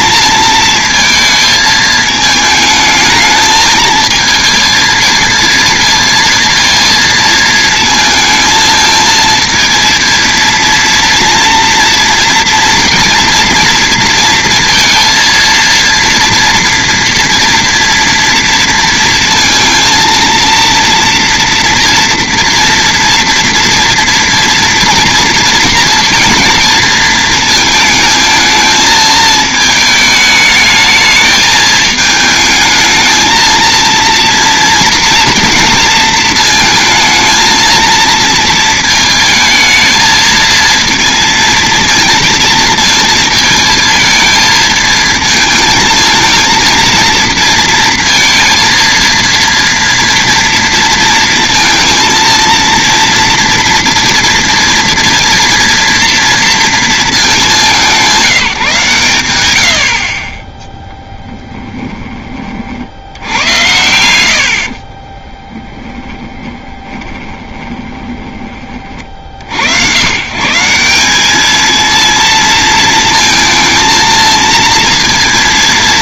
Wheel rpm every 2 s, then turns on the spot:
230, 220, 220, 230, 220, 230, 230, 230, 230, 230, 230, 240, 240, 230, 220, 210, 220, 230, 220, 220, 230, 220, 220, 230, 230, 230, 230, 230, 230, 160, 10, 40, 70, 20, 30, 170, 230, 230.
64-68